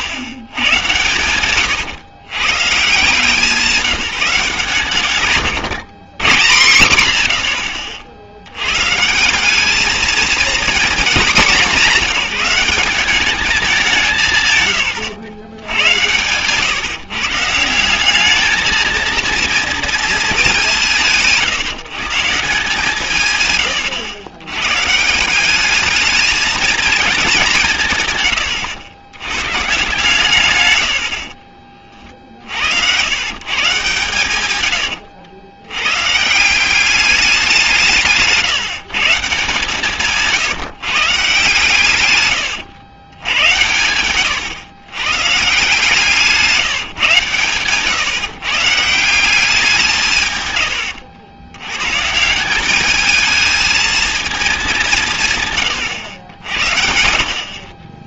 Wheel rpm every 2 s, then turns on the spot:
110, 140, 140, 140, 110, 230, 190, 130, 130, 220, 180, 160, 120, 220, 90, 110, 80, 100, 180, 160, 160, 100, 110, 160, 150, 110, 200, 190, 80.
none